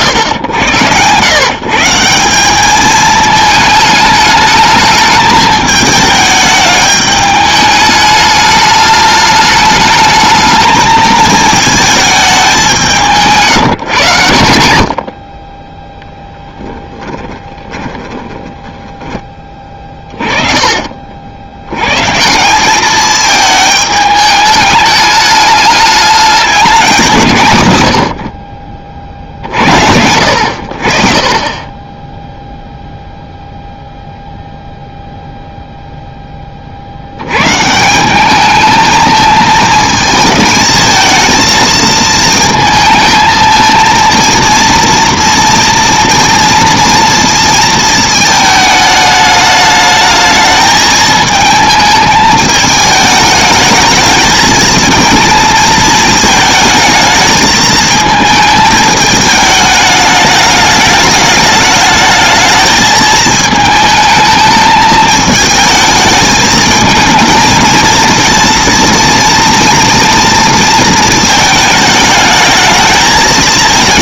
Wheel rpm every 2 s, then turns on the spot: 120, 200, 220, 210, 210, 220, 180, 80, 10, 10, 40, 200, 210, 200, 40, 70, 0, 0, 30, 210, 220, 220, 230, 230, 220, 220, 220, 220, 220, 220, 210, 220, 220, 220, 230, 230, 220.
16-22